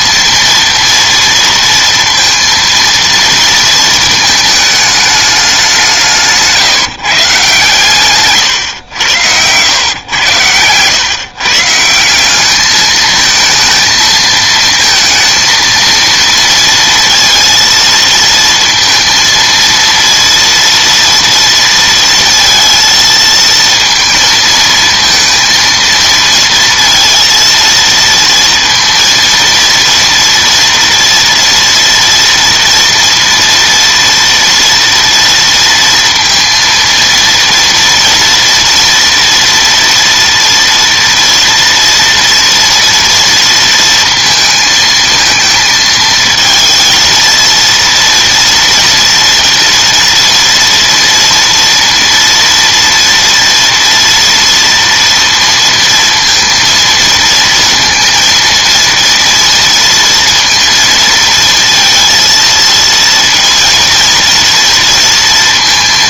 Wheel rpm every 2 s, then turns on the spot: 230, 230, 220, 150, 120, 110, 210, 230, 230, 230, 230, 230, 220, 230, 230, 230, 230, 230, 230, 230, 230, 230, 220, 230, 230, 230, 230, 230, 230, 230, 230, 230, 240.
8-10